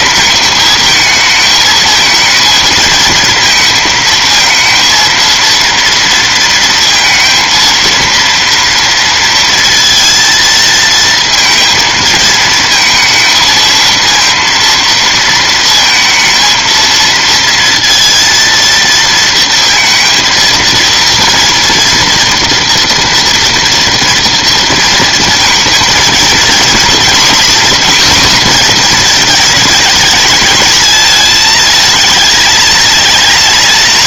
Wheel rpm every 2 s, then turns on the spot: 220, 230, 230, 230, 230, 230, 220, 230, 230, 230, 230, 230, 230, 240, 230, 220, 220.
none